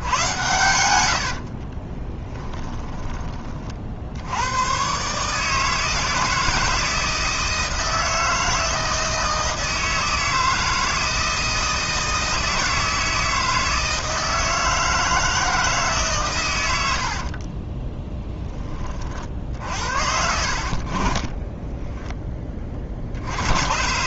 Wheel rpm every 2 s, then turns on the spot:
100, 20, 110, 160, 160, 160, 160, 160, 100, 20, 60, 30.
0-4